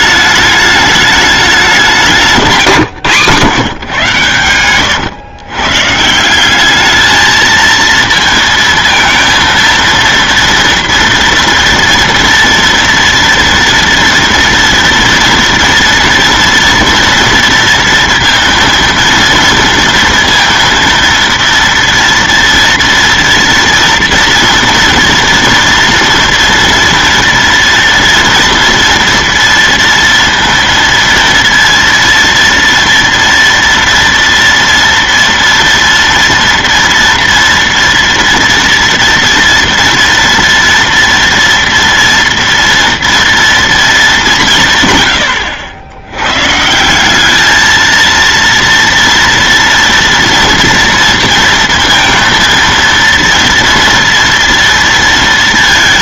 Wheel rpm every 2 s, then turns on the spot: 210, 190, 130, 170, 230, 230, 230, 230, 230, 230, 230, 230, 230, 230, 230, 230, 230, 230, 230, 230, 230, 230, 200, 100, 230, 240, 230, 230.
none